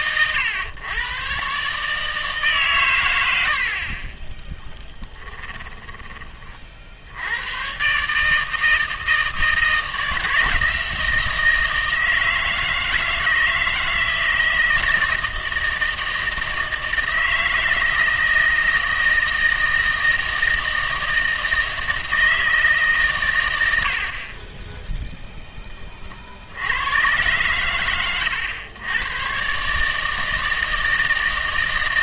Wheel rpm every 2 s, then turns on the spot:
110, 120, 10, 50, 160, 160, 160, 160, 160, 160, 160, 150, 10, 90, 100, 160.
4-6